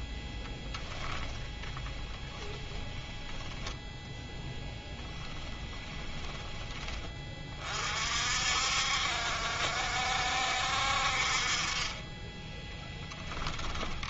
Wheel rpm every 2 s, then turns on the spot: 10, 10, 10, 20, 60, 60, 10.
12-14